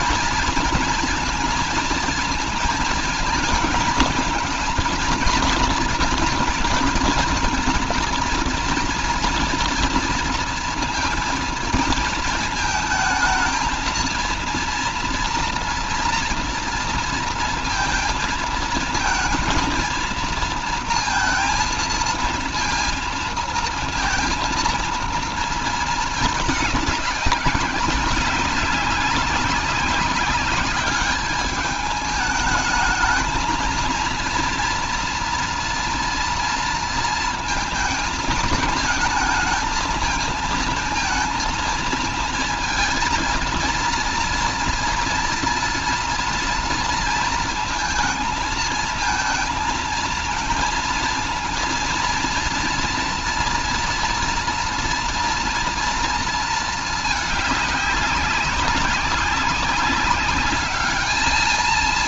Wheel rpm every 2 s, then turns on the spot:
230, 230, 230, 230, 230, 230, 220, 230, 230, 230, 230, 220, 230, 210, 200, 200, 220, 230, 230, 220, 230, 220, 230, 230, 230, 230, 230, 230, 220, 200, 210.
none